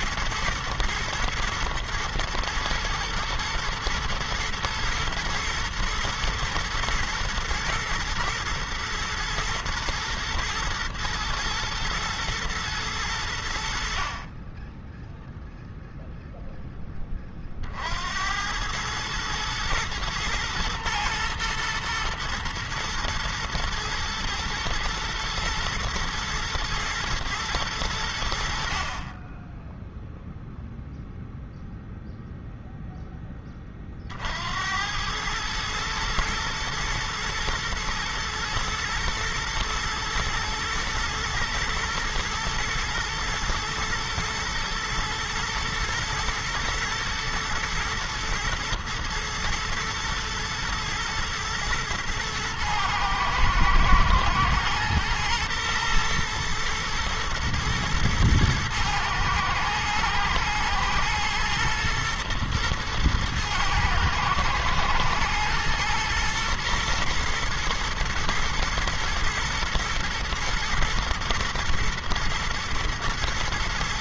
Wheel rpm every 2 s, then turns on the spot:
120, 120, 110, 110, 120, 120, 110, 30, 0, 90, 120, 110, 110, 120, 60, 0, 0, 80, 110, 110, 110, 110, 110, 120, 120, 110, 110, 110, 120, 110, 120, 110, 110, 110, 110, 120, 120.
none